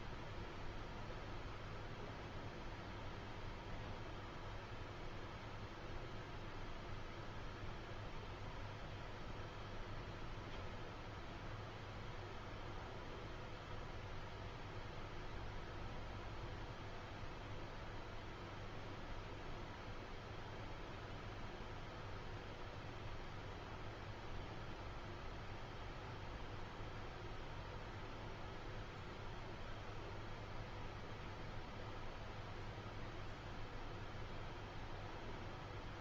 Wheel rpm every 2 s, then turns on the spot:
0, 0, 0, 0, 0, 0, 0, 0, 0, 0, 0, 0, 0, 0, 0, 0, 0, 0.
none